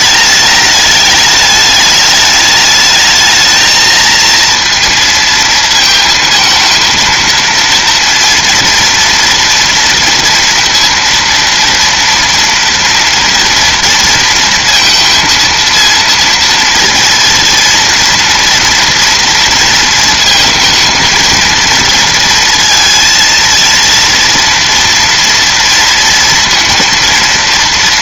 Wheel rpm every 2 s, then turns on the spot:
210, 220, 230, 230, 230, 230, 230, 230, 230, 230, 230, 230, 230, 230.
none